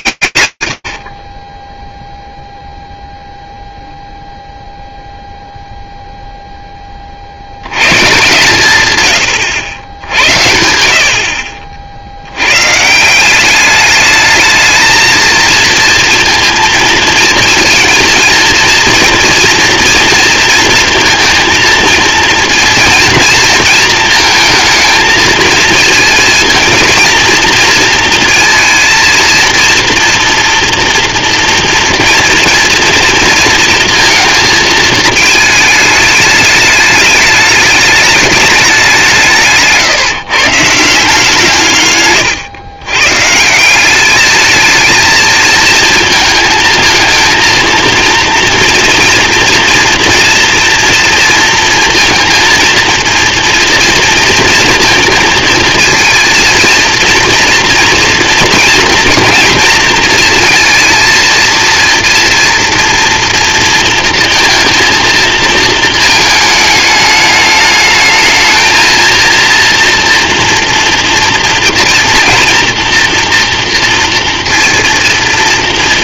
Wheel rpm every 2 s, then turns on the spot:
150, 0, 0, 30, 120, 80, 150, 230, 230, 230, 230, 230, 230, 230, 230, 230, 230, 220, 210, 190, 160, 140, 220, 220, 230, 230, 230, 220, 230, 230, 230, 230, 230, 210, 220, 230, 230, 230.
none